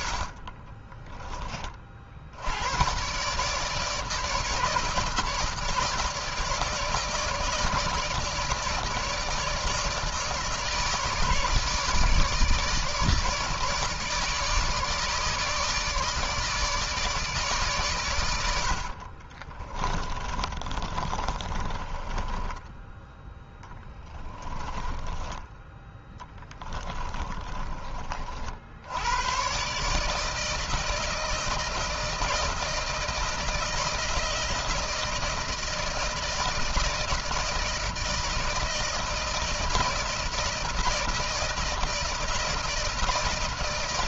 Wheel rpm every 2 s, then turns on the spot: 20, 130, 160, 160, 150, 150, 160, 160, 150, 60, 30, 10, 20, 20, 90, 160, 160, 160, 160, 160, 160, 160.
0-2 18-22 24-28